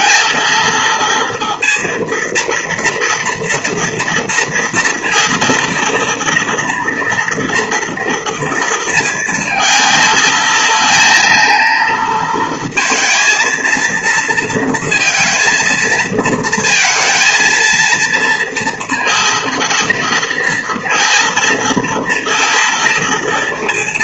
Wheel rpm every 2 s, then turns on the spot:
230, 230, 230, 230, 230, 220, 230, 230, 230, 230, 230, 230.
none